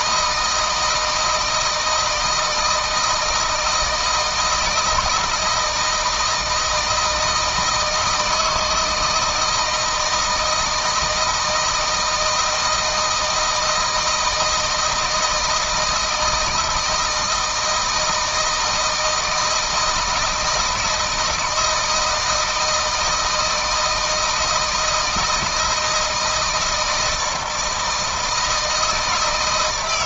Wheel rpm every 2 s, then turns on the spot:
160, 160, 160, 160, 160, 170, 160, 160, 160, 160, 160, 160, 160, 160, 160.
none